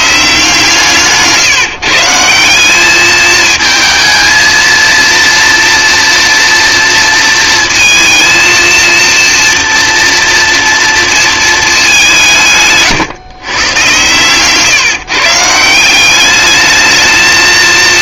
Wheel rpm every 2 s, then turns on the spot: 160, 200, 230, 230, 230, 230, 150, 140, 220.
none